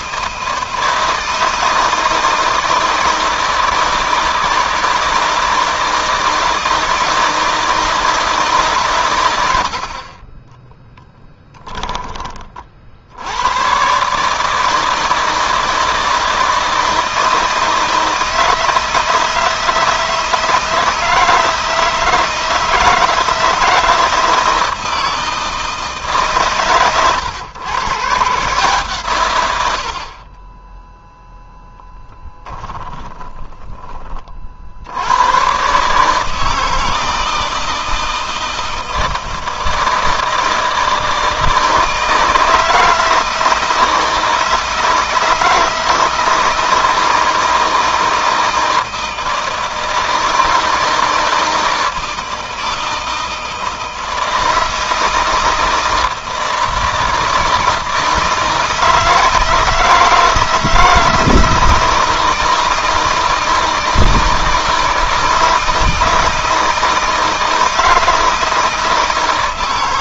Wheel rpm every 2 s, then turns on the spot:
160, 160, 160, 160, 120, 10, 80, 160, 160, 160, 160, 160, 160, 130, 140, 10, 30, 90, 160, 160, 160, 160, 160, 160, 160, 160, 160, 160, 160, 160, 160, 160, 160, 160, 160.
10-12 32-34